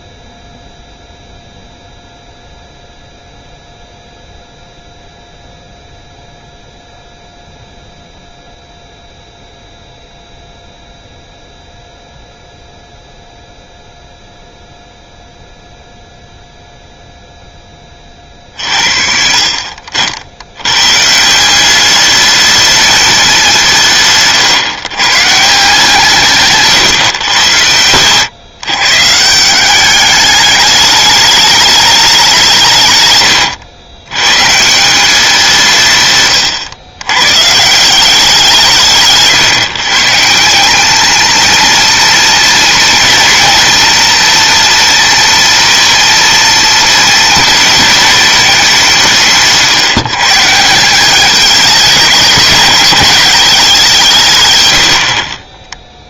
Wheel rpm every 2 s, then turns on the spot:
0, 0, 0, 0, 0, 0, 0, 0, 0, 50, 130, 210, 120, 120, 140, 210, 140, 170, 100, 160, 200, 230, 230, 230, 180, 170, 220, 90.
none